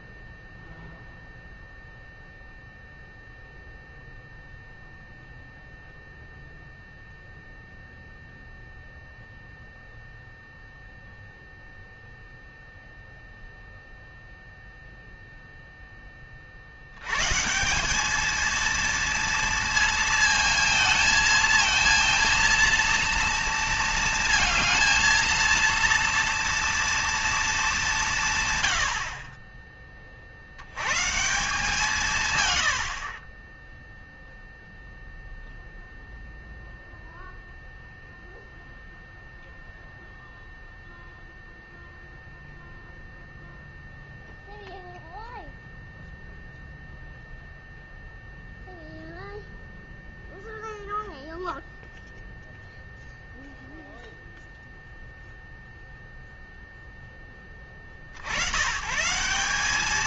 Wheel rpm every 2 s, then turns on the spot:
0, 0, 0, 0, 0, 0, 0, 0, 80, 230, 220, 230, 220, 230, 100, 100, 90, 0, 0, 0, 0, 0, 0, 0, 0, 0, 0, 0, 0, 120.
32-34